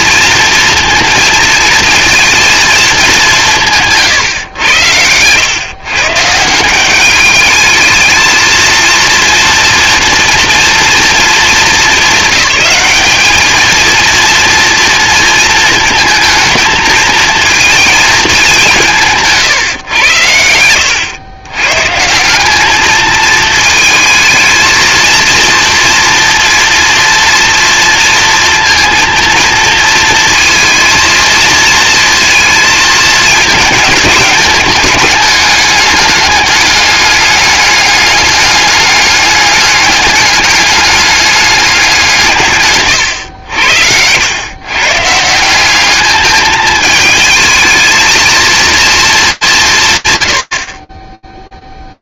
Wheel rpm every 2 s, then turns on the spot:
230, 230, 100, 180, 230, 230, 210, 230, 220, 170, 100, 210, 220, 230, 230, 230, 220, 210, 200, 200, 210, 130, 120, 220, 230, 40.
42-44